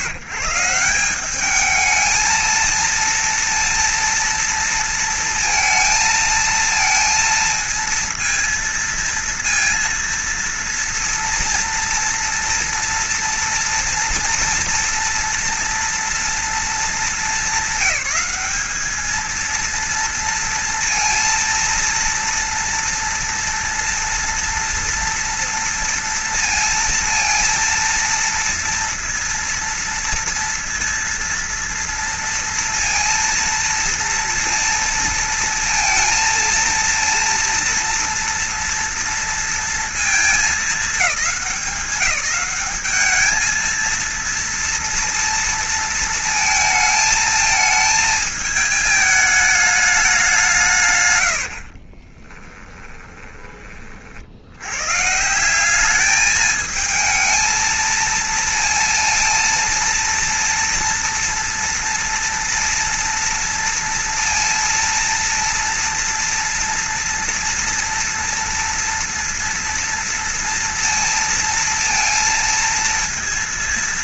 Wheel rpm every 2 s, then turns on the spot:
170, 220, 230, 220, 230, 230, 230, 240, 220, 210, 230, 230, 230, 230, 230, 230, 230, 230, 230, 240, 210, 210, 230, 220, 210, 140, 20, 120, 220, 230, 230, 230, 230, 230, 230, 230, 230.
52-54